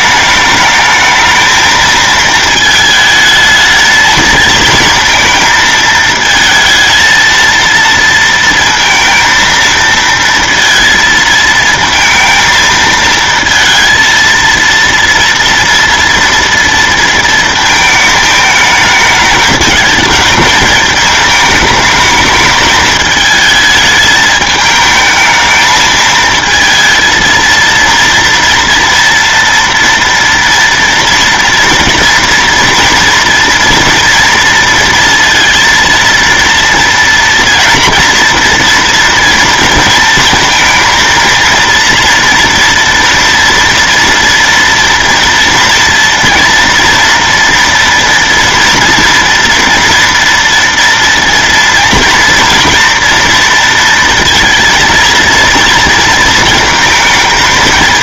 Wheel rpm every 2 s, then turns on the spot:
210, 220, 220, 220, 230, 230, 220, 230, 230, 210, 220, 210, 220, 230, 240, 240, 230, 230, 230, 230, 230, 230, 230, 240, 230, 230, 230, 230, 230.
none